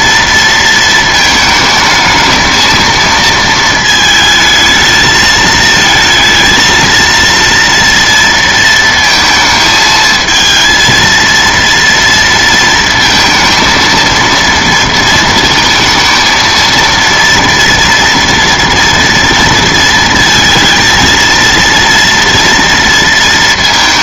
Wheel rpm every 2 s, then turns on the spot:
230, 230, 220, 230, 230, 230, 230, 230, 230, 230, 230, 230.
none